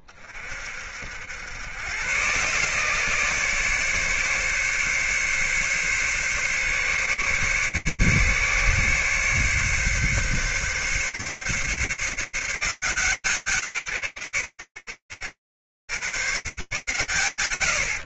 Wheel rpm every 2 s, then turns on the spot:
30, 120, 140, 140, 140, 140, 160, 100, 130.
none